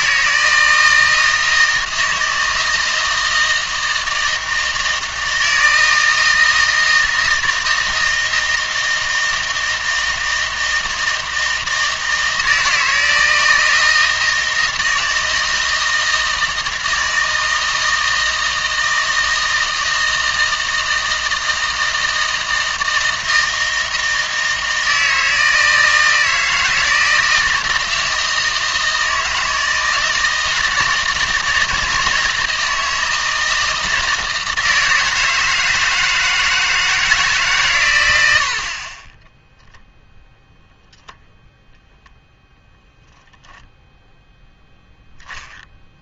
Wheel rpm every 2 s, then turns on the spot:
160, 160, 160, 160, 160, 160, 160, 160, 160, 160, 160, 160, 160, 160, 160, 160, 160, 160, 160, 60, 0, 0, 0.
none